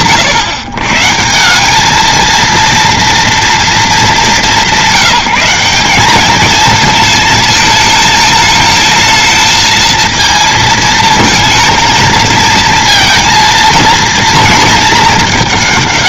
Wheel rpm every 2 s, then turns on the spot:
140, 230, 170, 220, 220, 220, 230, 220.
none